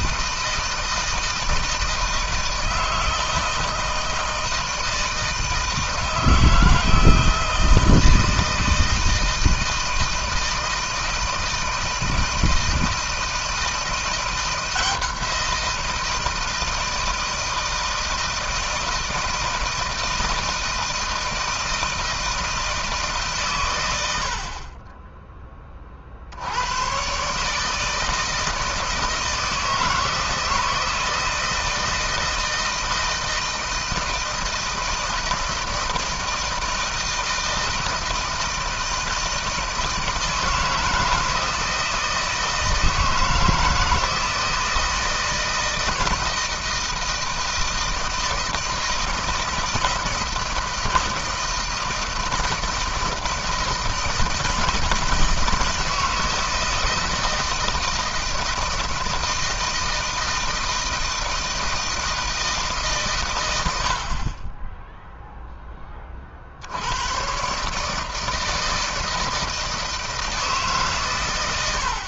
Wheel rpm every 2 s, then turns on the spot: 160, 160, 160, 160, 160, 160, 160, 170, 160, 160, 160, 160, 40, 90, 160, 160, 160, 160, 160, 160, 160, 160, 160, 170, 170, 170, 160, 160, 160, 160, 160, 150, 10, 70, 160, 150.
none